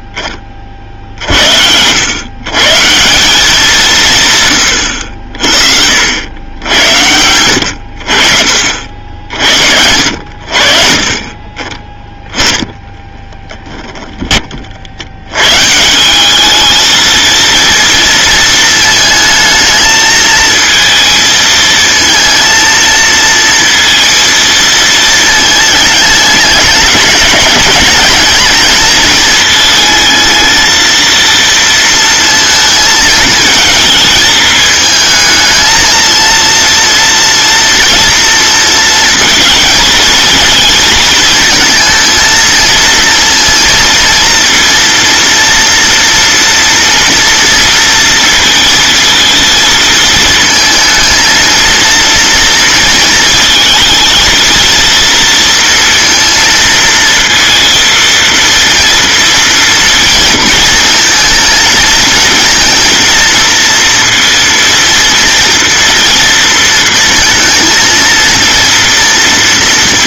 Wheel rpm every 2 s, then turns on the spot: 30, 140, 100, 80, 60, 70, 10, 50, 220, 220, 220, 230, 220, 200, 220, 220, 220, 220, 230, 230, 220, 230, 230, 230, 230, 230, 230, 230, 230, 230, 230, 230, 230, 230, 230.
none